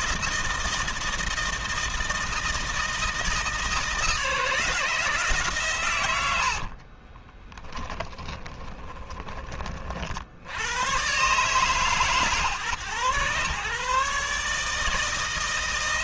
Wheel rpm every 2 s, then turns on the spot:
160, 160, 160, 60, 20, 100, 120, 150.
6-10